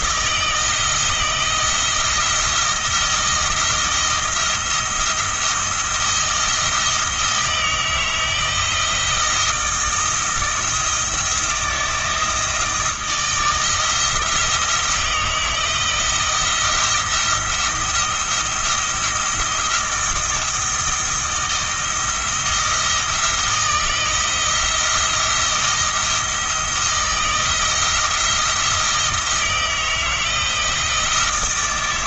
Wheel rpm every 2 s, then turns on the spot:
160, 170, 170, 160, 170, 160, 160, 160, 170, 170, 160, 170, 170, 160, 170, 160.
none